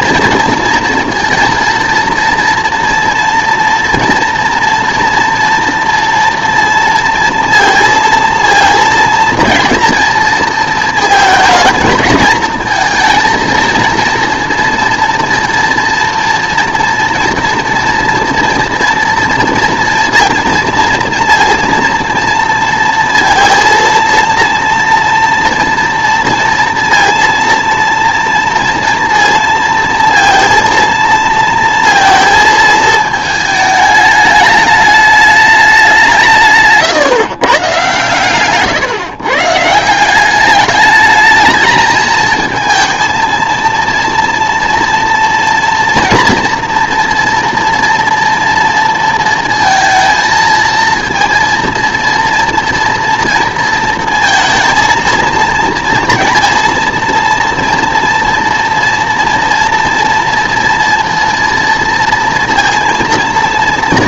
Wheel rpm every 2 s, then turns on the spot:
230, 230, 230, 230, 230, 220, 220, 230, 230, 230, 230, 230, 230, 230, 230, 230, 220, 210, 150, 140, 210, 220, 230, 230, 230, 230, 230, 230, 230, 230, 230, 230.
none